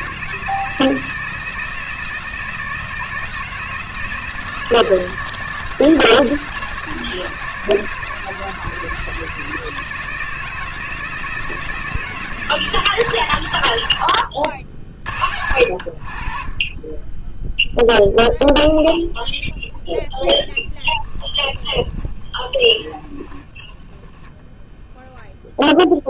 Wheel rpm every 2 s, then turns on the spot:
160, 170, 160, 170, 160, 160, 130, 50, 10, 0, 20, 30, 0.
20-24